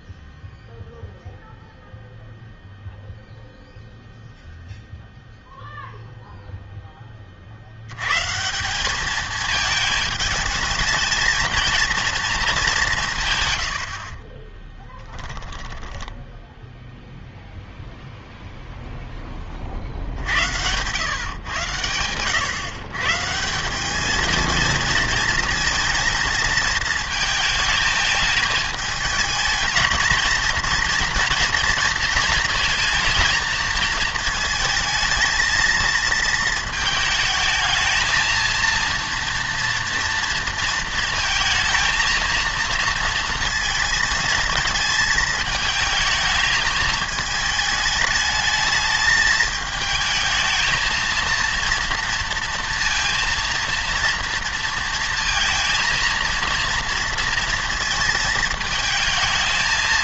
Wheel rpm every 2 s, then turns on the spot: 0, 0, 0, 0, 170, 210, 200, 10, 0, 0, 100, 120, 220, 230, 210, 230, 230, 220, 220, 230, 230, 230, 220, 220, 220, 220, 230, 230, 230, 220.
14-16